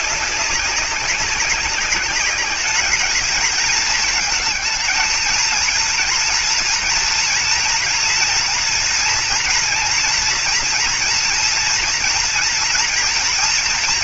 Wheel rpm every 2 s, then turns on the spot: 190, 210, 220, 230, 240, 240, 230.
none